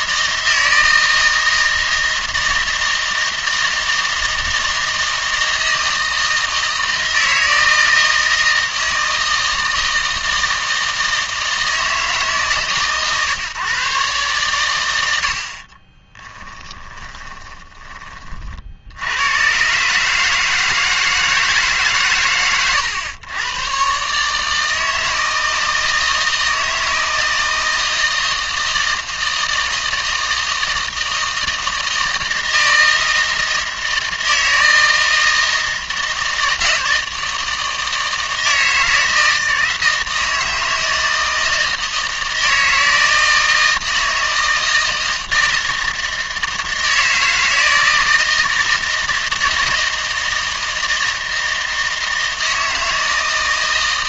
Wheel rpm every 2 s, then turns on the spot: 160, 160, 160, 160, 160, 160, 140, 100, 20, 70, 160, 110, 160, 160, 160, 160, 160, 160, 160, 160, 160, 160, 160, 160, 160, 160, 160.
16-18